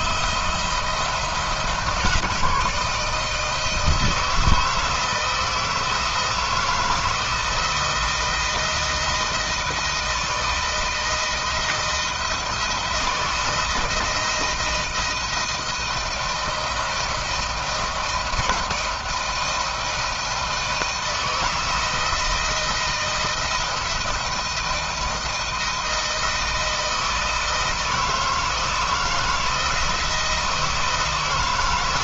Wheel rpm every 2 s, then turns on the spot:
170, 160, 160, 160, 160, 160, 160, 160, 160, 160, 160, 170, 170, 160, 160, 160.
none